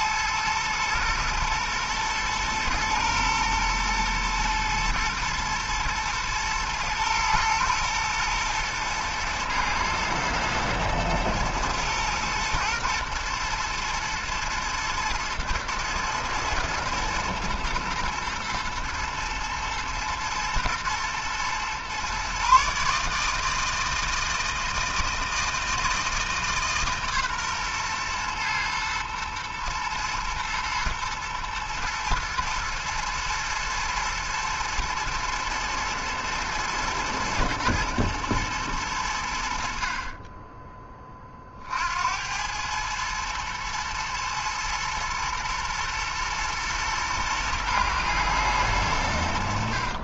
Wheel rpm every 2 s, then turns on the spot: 110, 110, 110, 110, 110, 110, 120, 110, 110, 120, 110, 140, 160, 150, 120, 110, 110, 110, 110, 110, 10, 100, 120, 120, 110.
none